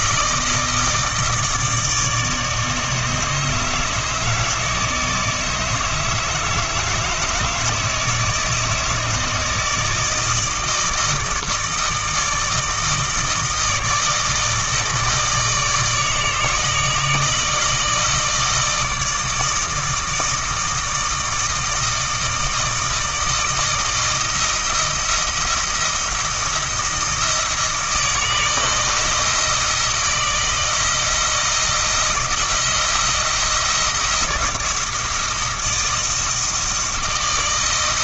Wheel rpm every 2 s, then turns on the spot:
160, 150, 160, 150, 160, 160, 160, 160, 160, 160, 160, 160, 160, 170, 160, 170, 160, 160, 160.
none